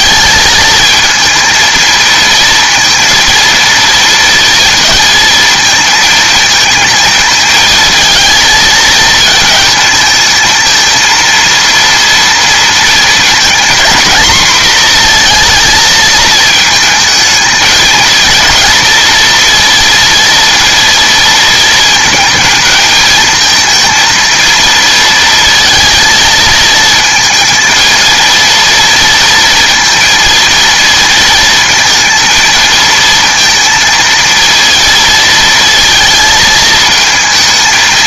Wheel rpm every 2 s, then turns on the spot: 220, 230, 230, 230, 220, 230, 230, 240, 220, 230, 230, 220, 230, 230, 230, 230, 230, 230, 220.
none